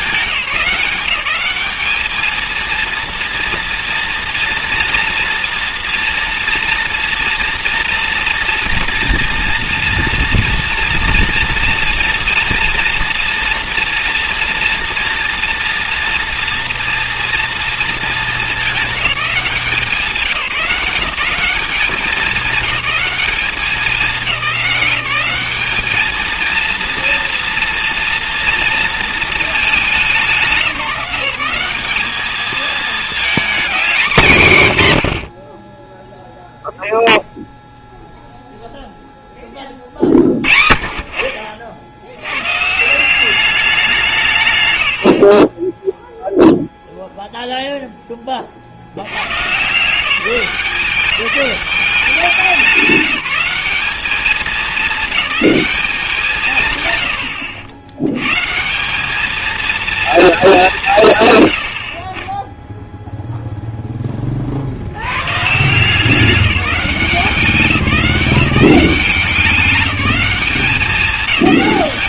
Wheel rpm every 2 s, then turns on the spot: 180, 230, 230, 240, 230, 230, 230, 230, 240, 210, 180, 210, 190, 230, 230, 190, 220, 110, 0, 0, 50, 140, 110, 0, 50, 190, 190, 210, 130, 160, 200, 10, 60, 190, 190, 190.
none